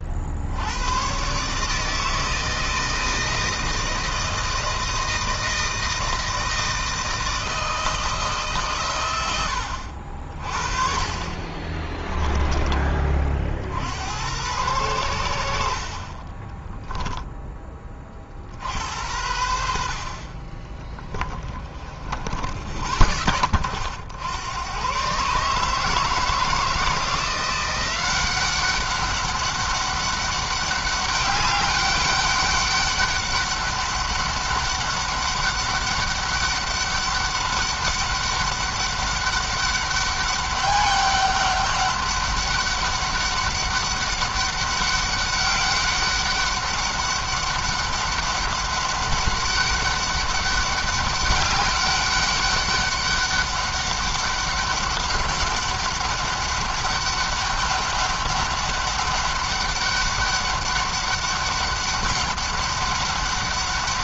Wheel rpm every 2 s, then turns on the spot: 110, 160, 160, 160, 130, 30, 20, 90, 20, 70, 30, 40, 110, 170, 190, 200, 200, 200, 200, 200, 200, 200, 200, 200, 200, 200, 200, 200, 200, 200, 200, 200.
16-18 20-22